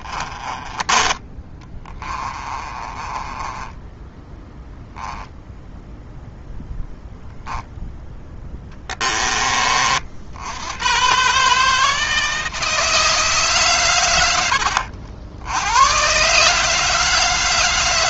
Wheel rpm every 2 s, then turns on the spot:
20, 20, 0, 0, 20, 120, 160, 70, 150.
2-4